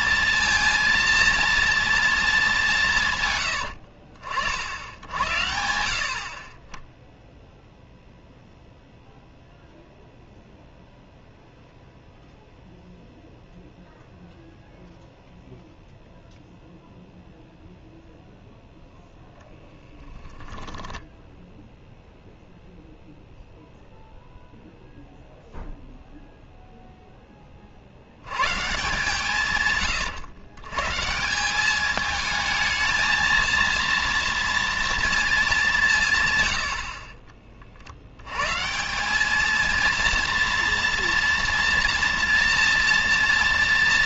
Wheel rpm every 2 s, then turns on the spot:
230, 140, 80, 0, 0, 0, 0, 0, 0, 0, 10, 0, 0, 10, 140, 160, 230, 230, 40, 200, 230, 230.
20-22 36-38